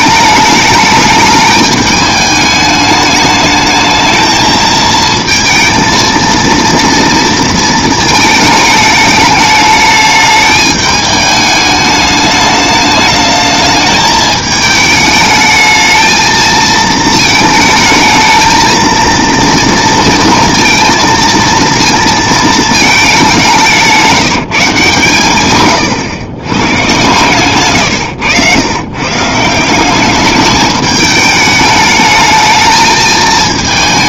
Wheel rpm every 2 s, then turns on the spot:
210, 210, 220, 230, 220, 210, 210, 220, 220, 220, 230, 220, 160, 120, 100, 210, 220.
none